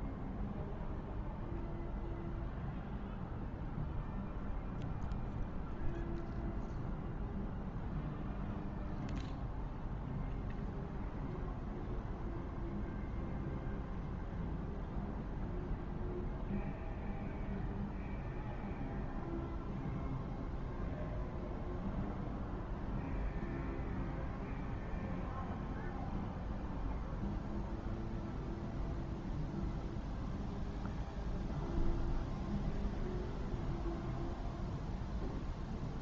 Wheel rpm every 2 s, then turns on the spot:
0, 0, 0, 0, 0, 0, 0, 0, 0, 0, 0, 0, 0, 0, 0, 0, 0, 0.
none